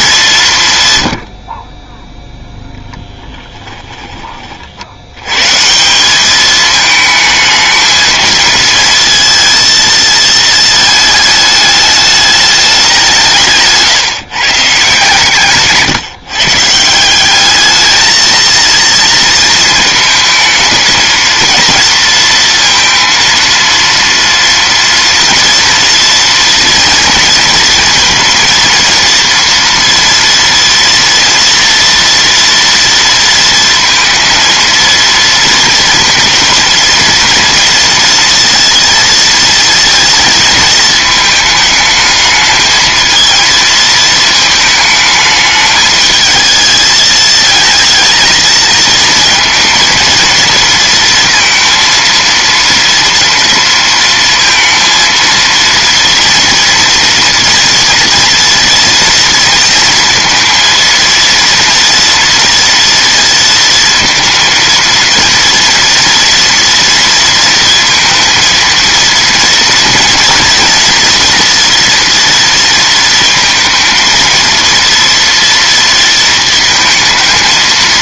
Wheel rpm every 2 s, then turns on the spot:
140, 0, 50, 210, 230, 220, 200, 150, 150, 230, 220, 230, 230, 230, 230, 230, 240, 230, 230, 230, 220, 220, 220, 220, 220, 230, 230, 230, 230, 240, 230, 230, 220, 230, 230, 230, 230, 230, 220.
none